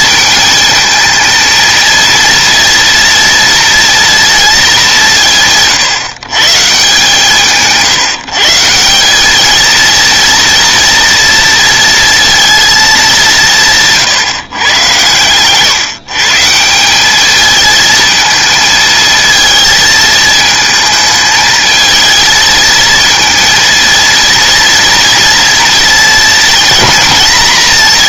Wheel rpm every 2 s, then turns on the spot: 220, 230, 210, 140, 170, 230, 220, 130, 180, 220, 220, 230, 230, 230.
none